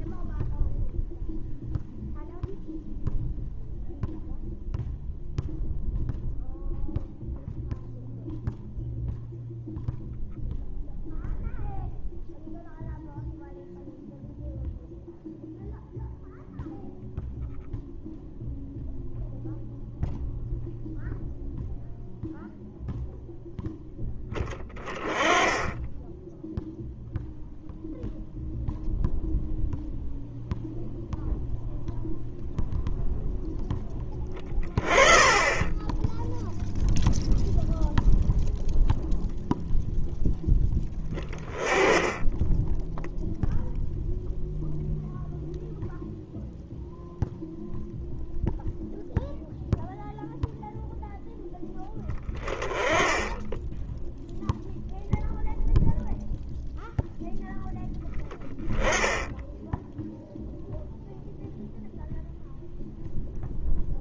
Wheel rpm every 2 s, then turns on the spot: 0, 0, 0, 0, 0, 0, 0, 0, 0, 0, 0, 0, 20, 0, 0, 0, 0, 20, 0, 0, 10, 0, 0, 0, 0, 0, 10, 0, 0, 20, 0, 0.
none